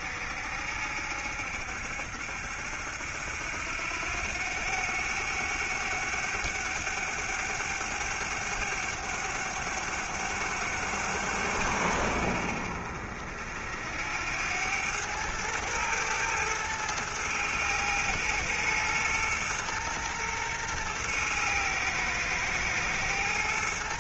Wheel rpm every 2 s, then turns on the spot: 70, 70, 100, 100, 100, 100, 60, 100, 110, 120, 120, 110.
none